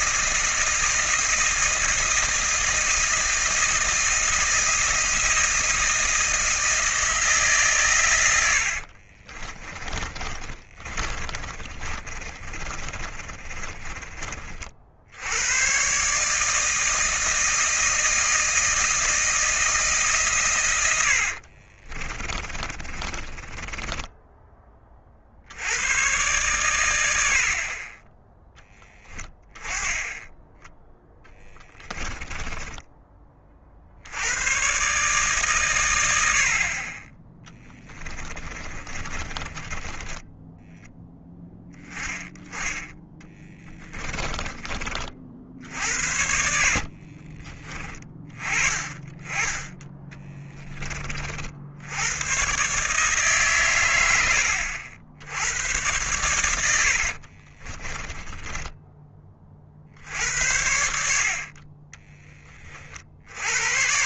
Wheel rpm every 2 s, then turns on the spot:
160, 160, 160, 160, 60, 30, 30, 60, 160, 160, 100, 30, 20, 100, 10, 10, 20, 140, 30, 20, 10, 10, 30, 50, 20, 20, 140, 70, 80, 10, 70, 30.
8-14 20-24 38-40 46-48 56-60